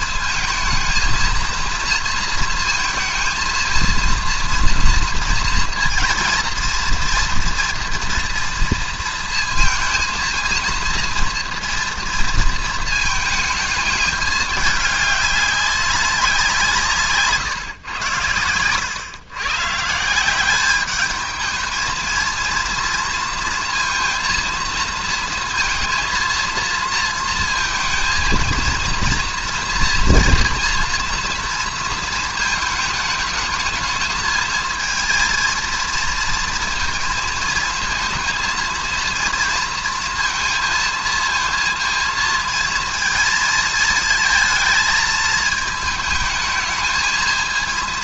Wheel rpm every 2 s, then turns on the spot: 220, 220, 230, 230, 230, 230, 220, 210, 170, 110, 200, 230, 230, 230, 230, 230, 220, 220, 230, 230, 220, 230, 220, 220.
none